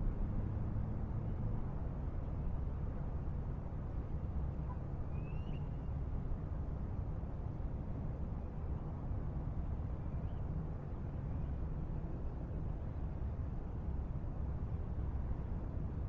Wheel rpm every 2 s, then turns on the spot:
0, 0, 0, 0, 0, 0, 0, 0.
none